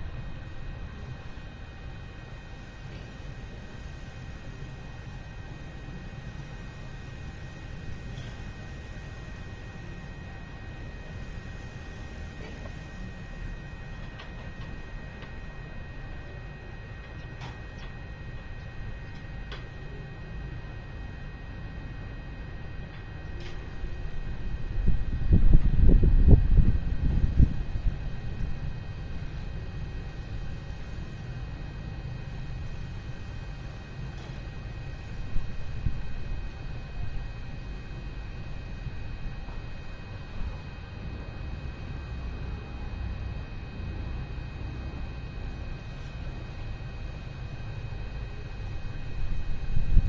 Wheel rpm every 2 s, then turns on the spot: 0, 0, 0, 0, 0, 0, 0, 0, 0, 0, 0, 0, 0, 0, 0, 0, 0, 0, 0, 0, 0, 0, 0, 0, 0.
none